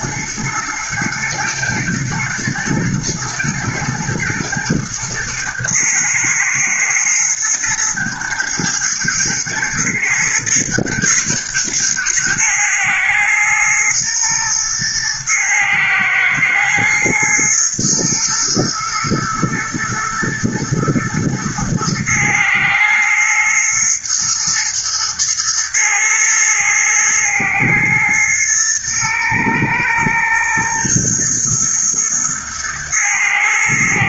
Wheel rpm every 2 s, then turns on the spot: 120, 120, 120, 120, 110, 120, 120, 110, 120, 110, 110, 110, 110, 110, 110, 120, 120.
none